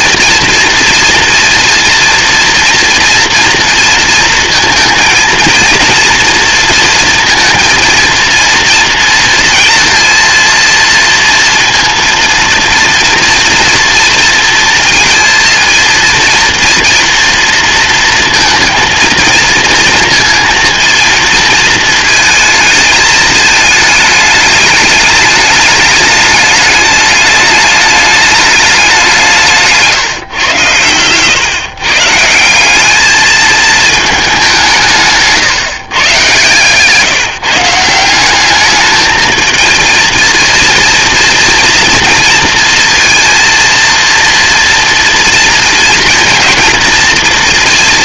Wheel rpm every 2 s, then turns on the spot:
240, 230, 230, 230, 230, 230, 230, 230, 230, 230, 230, 230, 210, 210, 210, 120, 170, 200, 130, 190, 230, 230, 230, 230.
none